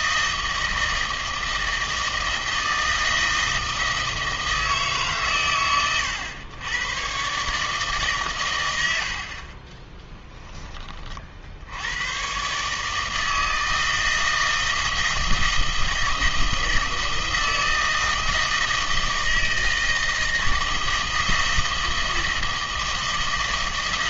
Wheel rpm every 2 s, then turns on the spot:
160, 160, 160, 100, 100, 20, 140, 160, 160, 160, 160, 160.
none